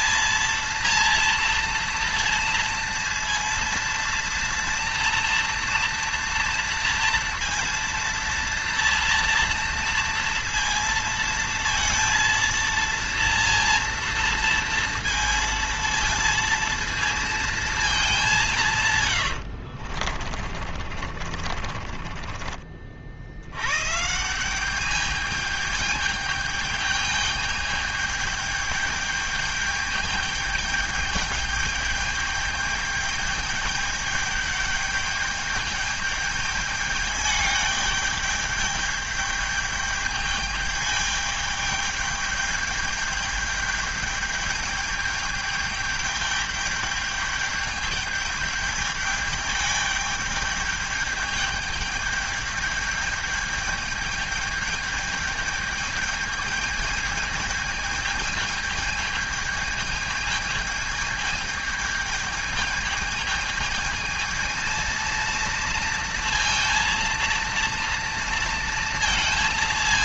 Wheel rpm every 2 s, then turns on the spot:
230, 230, 230, 230, 230, 230, 230, 230, 230, 180, 50, 40, 180, 210, 210, 210, 210, 210, 210, 210, 210, 210, 210, 210, 210, 210, 210, 210, 210, 220, 220, 220, 220, 230, 230.
18-24